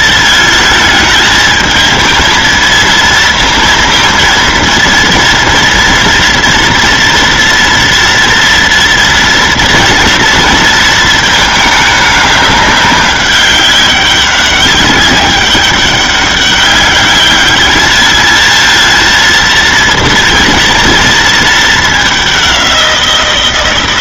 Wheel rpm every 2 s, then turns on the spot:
230, 220, 230, 230, 230, 230, 210, 190, 200, 220, 230, 200.
none